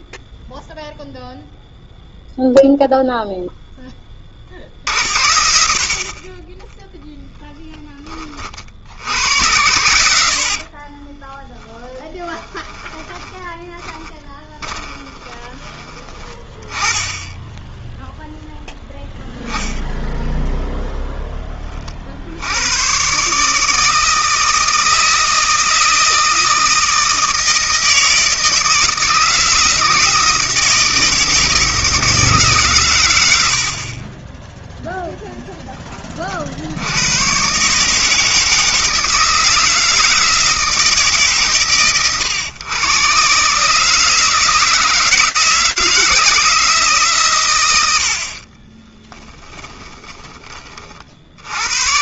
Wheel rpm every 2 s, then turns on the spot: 0, 0, 40, 20, 40, 70, 10, 20, 20, 0, 0, 80, 160, 160, 160, 170, 150, 10, 50, 160, 160, 120, 160, 160, 40, 30.
10-16 48-50